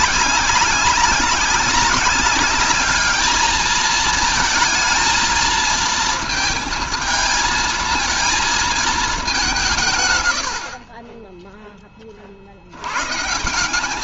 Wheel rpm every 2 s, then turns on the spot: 190, 210, 220, 230, 220, 60, 90.
none